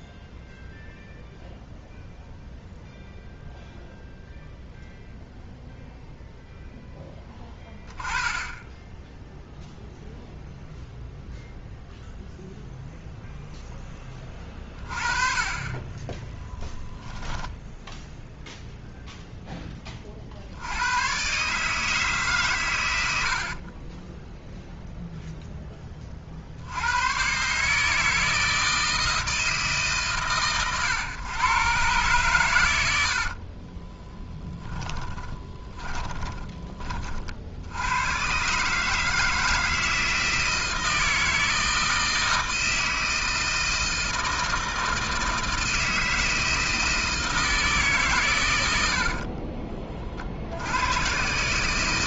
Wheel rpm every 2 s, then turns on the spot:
0, 0, 0, 0, 10, 0, 0, 30, 10, 0, 70, 130, 0, 50, 160, 130, 110, 10, 20, 130, 160, 160, 160, 160, 100, 80.
16-18 34-36